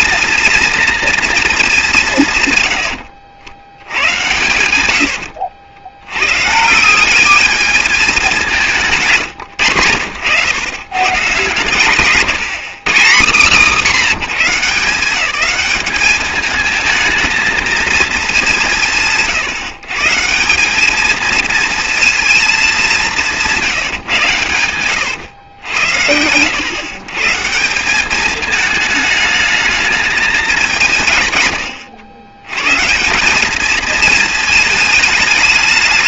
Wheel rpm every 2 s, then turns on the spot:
240, 90, 90, 180, 150, 120, 170, 160, 220, 180, 210, 190, 110, 130, 210, 170, 150, 210.
2-6